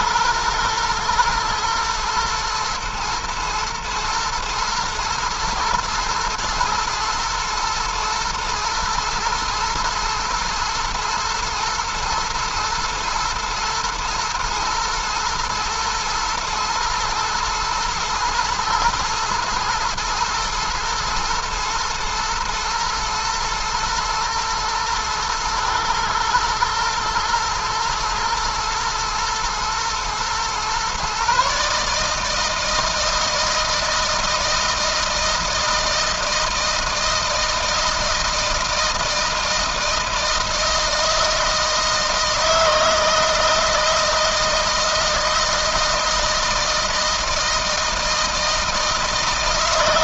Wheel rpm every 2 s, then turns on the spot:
120, 110, 110, 120, 120, 120, 120, 120, 110, 110, 110, 120, 110, 120, 120, 130, 160, 160, 160, 160, 160, 160, 160, 170, 160.
none